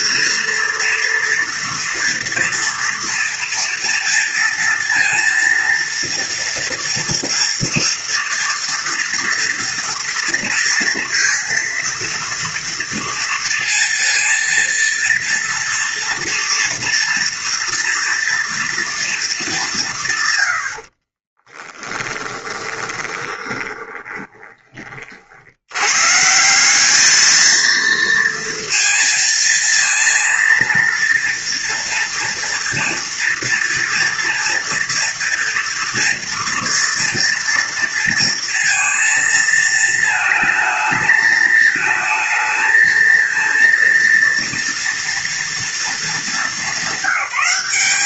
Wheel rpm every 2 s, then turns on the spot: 230, 230, 230, 230, 230, 230, 230, 230, 230, 240, 110, 10, 20, 180, 230, 230, 240, 230, 230, 230, 220, 230, 230, 200.
22-24